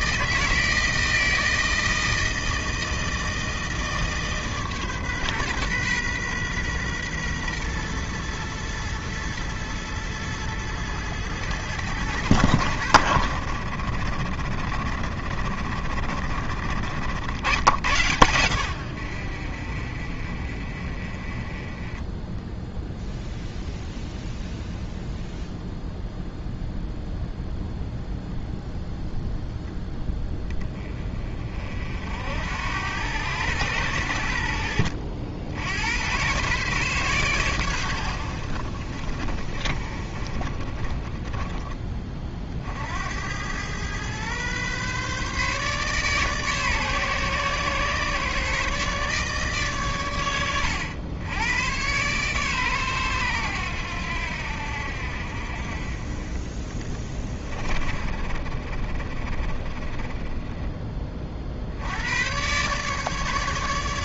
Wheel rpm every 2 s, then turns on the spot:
160, 160, 140, 120, 110, 110, 80, 50, 90, 70, 30, 0, 0, 0, 0, 30, 90, 70, 130, 30, 20, 90, 140, 130, 140, 100, 110, 60, 20, 30, 30, 150.
none